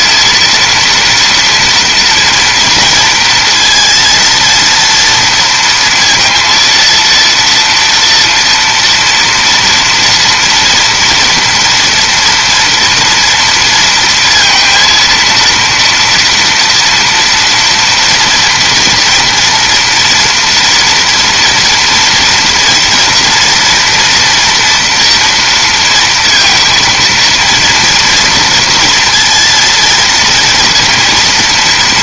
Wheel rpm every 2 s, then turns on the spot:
230, 230, 230, 230, 230, 230, 230, 230, 230, 230, 230, 230, 230, 230, 230, 230.
none